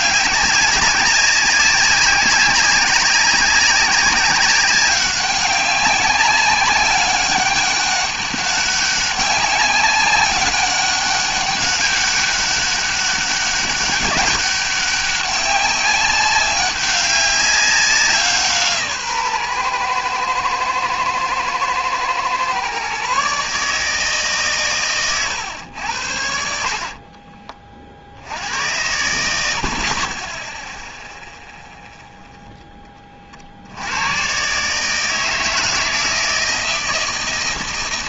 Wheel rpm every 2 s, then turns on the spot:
190, 190, 190, 200, 200, 200, 200, 200, 190, 160, 110, 130, 130, 50, 90, 10, 10, 140, 160.
26-28